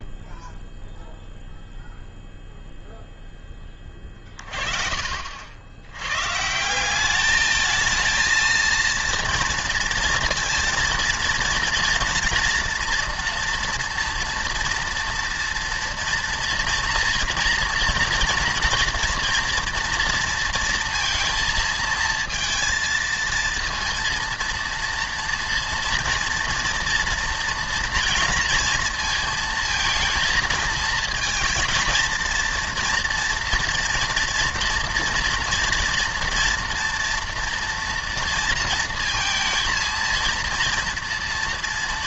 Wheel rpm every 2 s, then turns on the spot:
0, 0, 30, 170, 230, 230, 230, 230, 230, 230, 230, 230, 230, 230, 230, 230, 230, 230, 230, 230, 230.
4-6